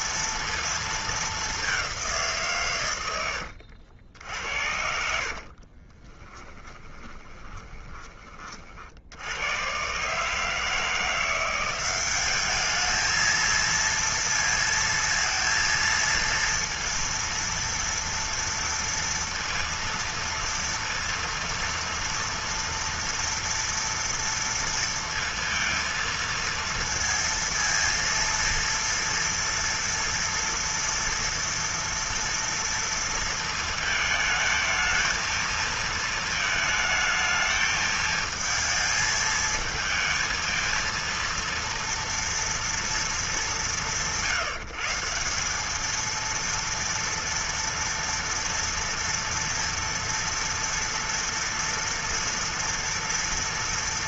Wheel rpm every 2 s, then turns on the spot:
230, 150, 70, 20, 30, 150, 200, 230, 230, 230, 230, 230, 230, 230, 230, 240, 230, 220, 220, 220, 230, 230, 160, 230, 230, 230, 240.
6-8